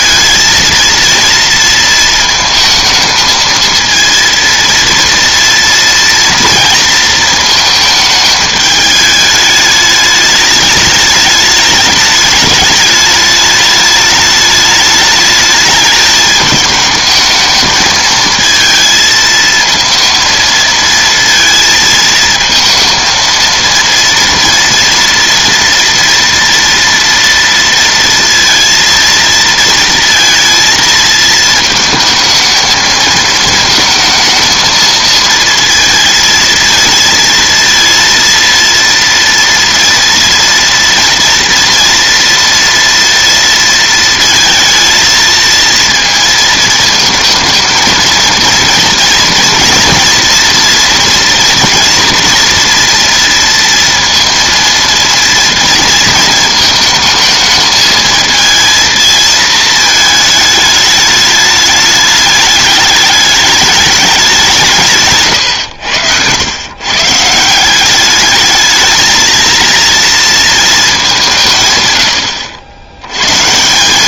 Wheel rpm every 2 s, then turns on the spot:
230, 220, 230, 230, 210, 210, 210, 210, 210, 220, 230, 230, 230, 230, 230, 230, 220, 230, 230, 230, 230, 230, 220, 220, 230, 240, 230, 230, 220, 230, 210, 210, 180, 110, 220, 220, 80.
none